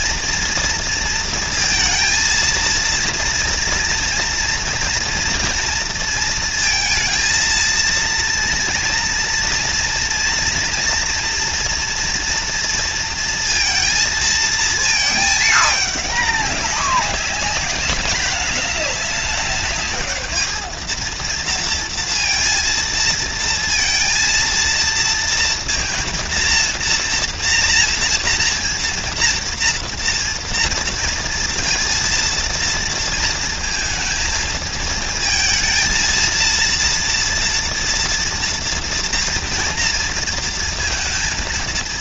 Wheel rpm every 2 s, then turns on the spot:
230, 230, 230, 230, 230, 230, 230, 220, 200, 200, 220, 230, 230, 230, 230, 230, 230, 220, 230, 230, 230.
none